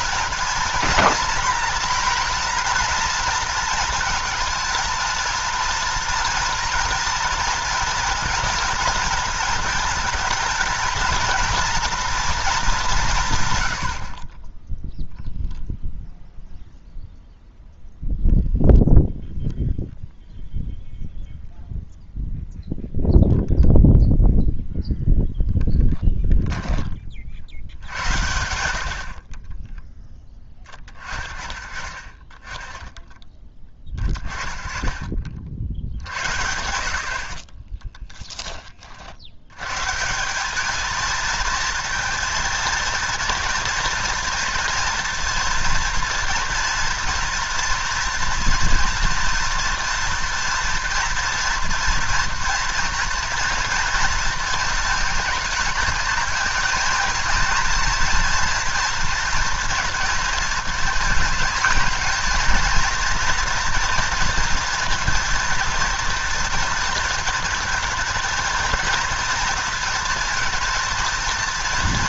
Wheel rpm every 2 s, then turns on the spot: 230, 240, 230, 240, 230, 220, 210, 10, 0, 0, 0, 0, 0, 10, 70, 20, 10, 30, 80, 30, 210, 230, 230, 230, 230, 230, 230, 220, 230, 230, 230, 230, 230, 230, 230, 230.
none